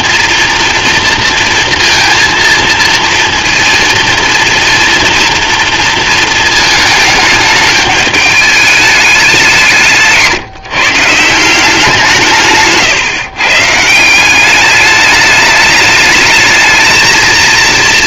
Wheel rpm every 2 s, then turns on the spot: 230, 230, 240, 220, 200, 160, 140, 210, 230.
none